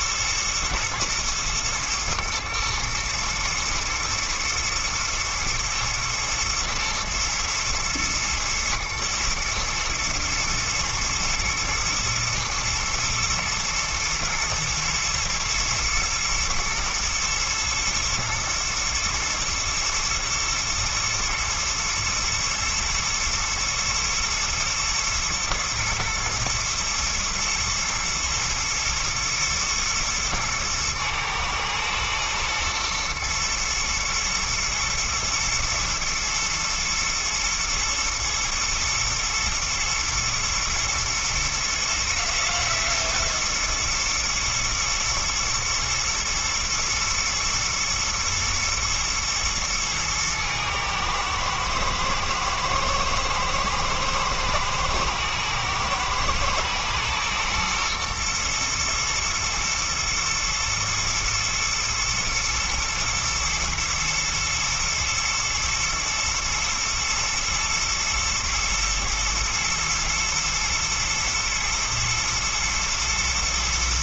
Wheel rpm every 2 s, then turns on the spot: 120, 120, 110, 120, 110, 120, 110, 110, 120, 110, 110, 120, 110, 110, 110, 110, 120, 110, 110, 120, 120, 110, 110, 110, 120, 110, 110, 110, 120, 120, 110, 110, 120, 120, 120, 110, 110.
none